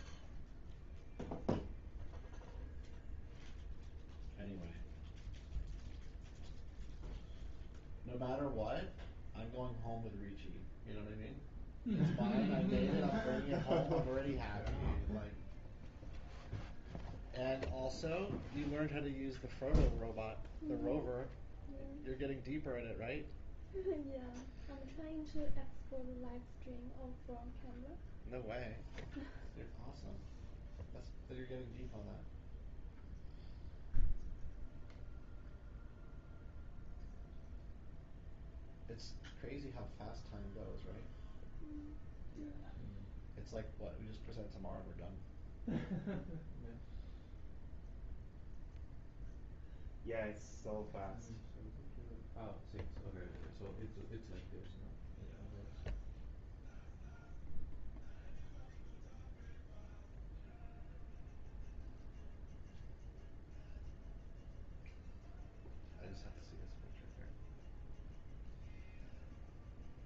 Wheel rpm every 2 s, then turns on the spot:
0, 0, 0, 0, 0, 0, 0, 0, 0, 0, 0, 0, 0, 0, 0, 0, 0, 0, 0, 0, 0, 0, 0, 0, 0, 0, 0, 0, 0, 0, 0, 0, 0, 0, 0.
none